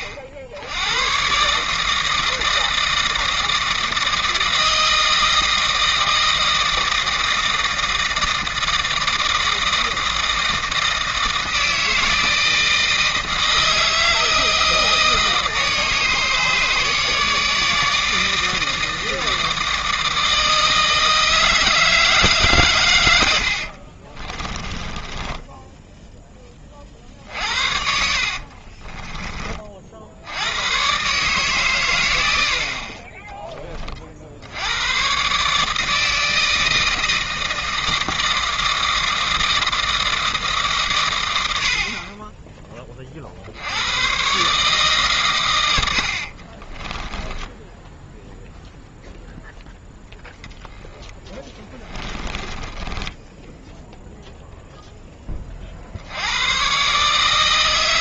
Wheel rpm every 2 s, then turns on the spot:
80, 160, 160, 160, 160, 160, 160, 160, 150, 160, 160, 120, 20, 30, 40, 110, 60, 100, 160, 160, 140, 20, 140, 30, 0, 0, 20, 0, 130.
24-26 28-30 46-48 52-54